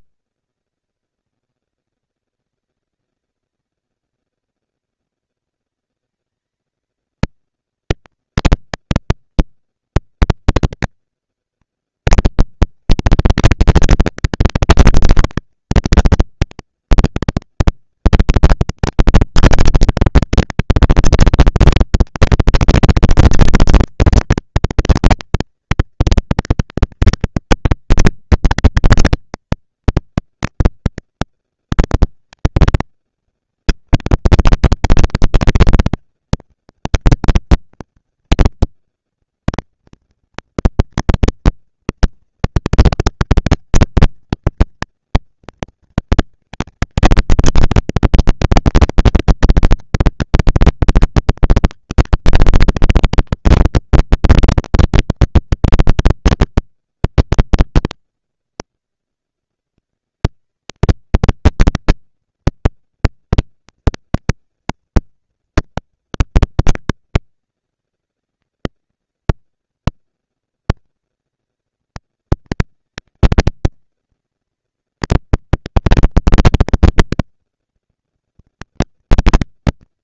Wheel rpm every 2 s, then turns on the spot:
200, 200, 210, 220, 230, 230, 230, 230, 240, 230, 230, 230, 230, 230, 230, 230, 220, 200, 190, 220, 230, 240, 230, 230, 240, 240, 230, 230, 230, 230, 230, 230, 230, 210, 200, 210, 220, 230, 240, 240.
none